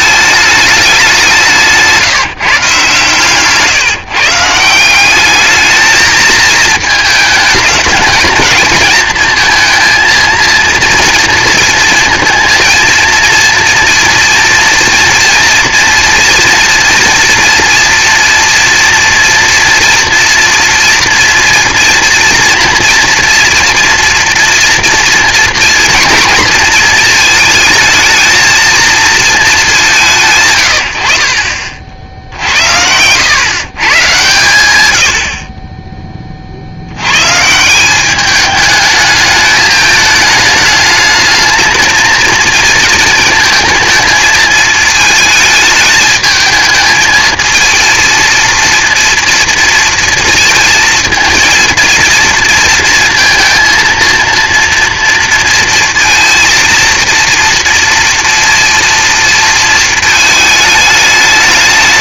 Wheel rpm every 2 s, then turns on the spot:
210, 140, 170, 220, 220, 230, 230, 240, 230, 230, 240, 230, 230, 230, 220, 130, 70, 110, 60, 210, 210, 230, 220, 220, 230, 230, 230, 230, 230, 230, 220.
32-34